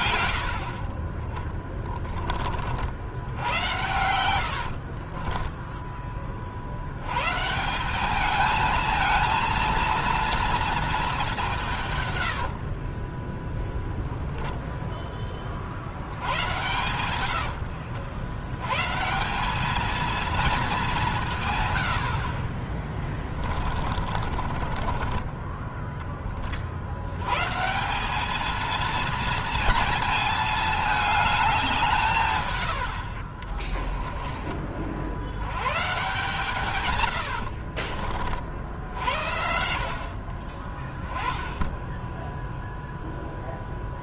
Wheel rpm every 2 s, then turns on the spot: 60, 40, 80, 50, 210, 230, 60, 0, 90, 100, 220, 50, 30, 50, 220, 220, 130, 30, 140, 50, 40, 0.
4-6 12-14 24-26 36-38